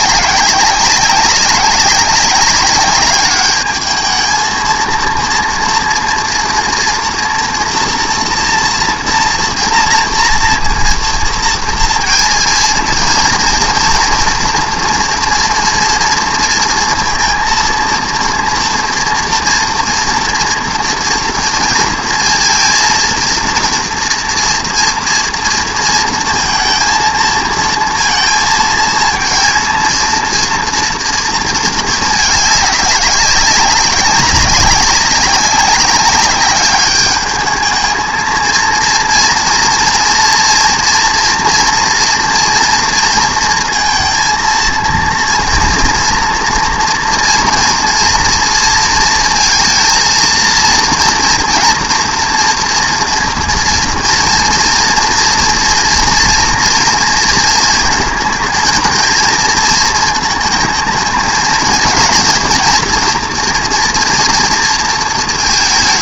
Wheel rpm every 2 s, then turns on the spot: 190, 200, 220, 230, 230, 230, 230, 230, 230, 230, 230, 230, 230, 230, 230, 230, 210, 190, 200, 230, 240, 230, 230, 230, 230, 230, 240, 230, 230, 220, 220, 230, 230.
none